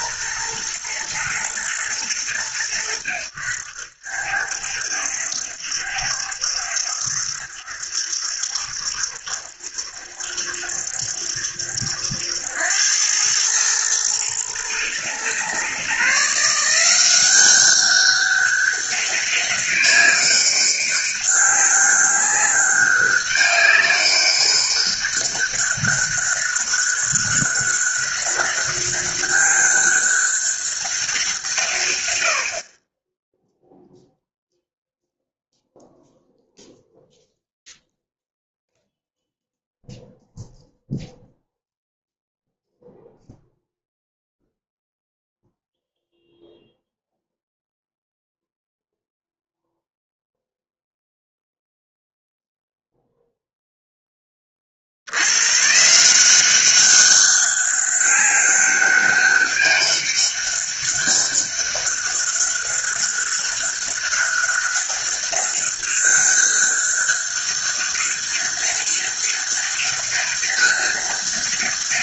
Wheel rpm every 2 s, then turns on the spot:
120, 90, 70, 70, 70, 70, 100, 120, 180, 200, 200, 200, 200, 200, 200, 190, 20, 0, 0, 0, 0, 0, 0, 0, 0, 0, 0, 60, 190, 200, 200, 200, 200, 200, 200, 200.
none